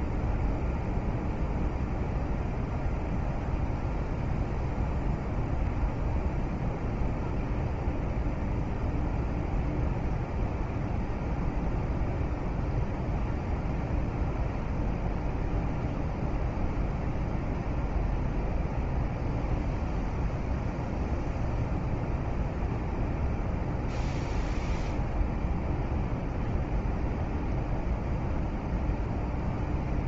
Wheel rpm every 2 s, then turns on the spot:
0, 0, 0, 0, 0, 0, 0, 0, 0, 0, 0, 0, 0, 0, 0.
none